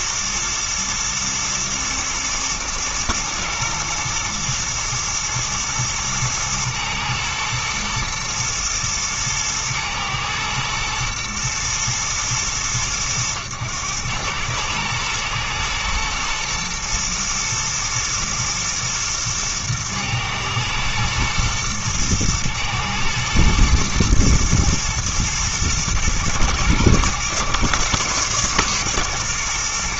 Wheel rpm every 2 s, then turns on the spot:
110, 120, 120, 110, 110, 110, 110, 110, 110, 110, 110, 110, 110, 110, 120.
none